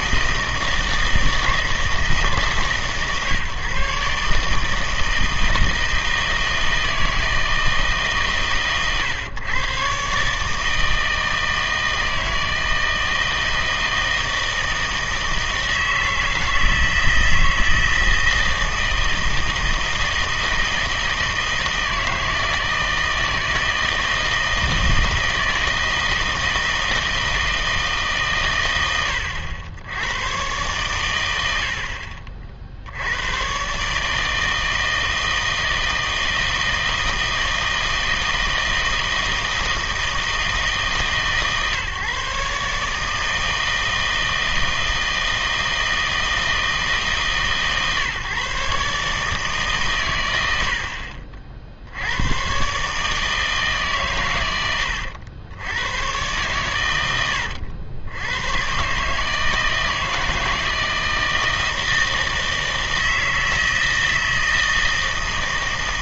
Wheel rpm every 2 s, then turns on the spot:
160, 140, 150, 160, 130, 160, 160, 160, 160, 160, 160, 160, 160, 160, 100, 120, 60, 160, 160, 160, 150, 140, 160, 160, 140, 80, 130, 110, 110, 120, 160, 160, 160.
none